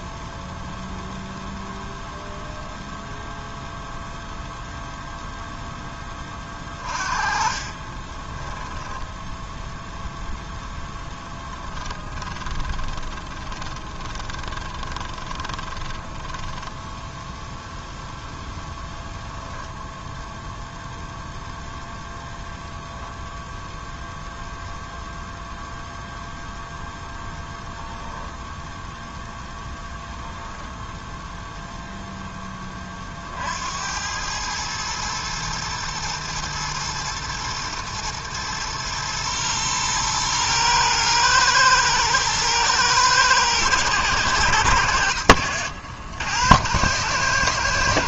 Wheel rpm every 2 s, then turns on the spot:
0, 0, 0, 30, 10, 0, 20, 20, 10, 0, 0, 0, 0, 0, 10, 0, 10, 100, 110, 110, 120, 110, 110, 90.
6-10 12-18